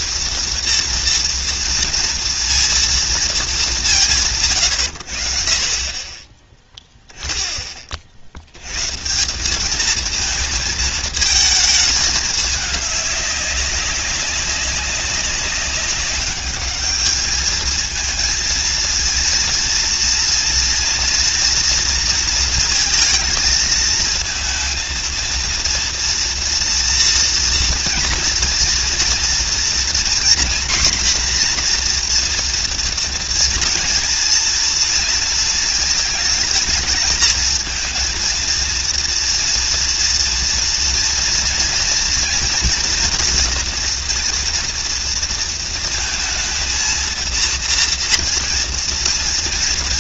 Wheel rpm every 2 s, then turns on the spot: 230, 230, 140, 10, 90, 220, 210, 200, 210, 230, 230, 230, 220, 230, 230, 250, 240, 230, 220, 230, 230, 230, 230, 230, 230.
none